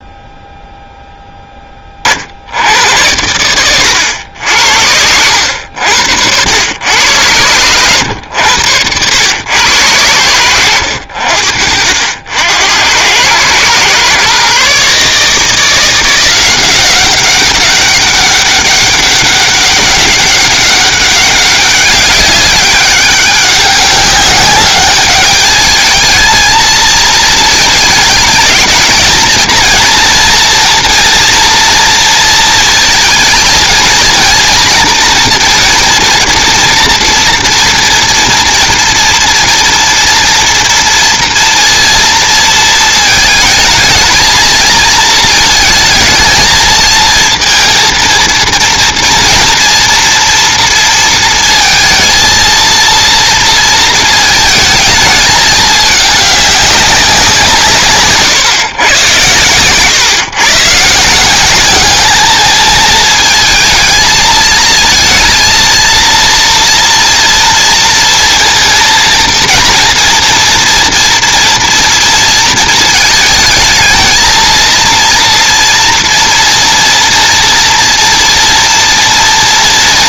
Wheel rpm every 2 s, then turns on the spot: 0, 90, 70, 100, 100, 80, 90, 140, 180, 200, 200, 200, 210, 220, 220, 230, 230, 240, 230, 230, 230, 230, 220, 220, 230, 230, 230, 220, 190, 120, 140, 220, 220, 240, 230, 230, 220, 230, 240, 230.
8-12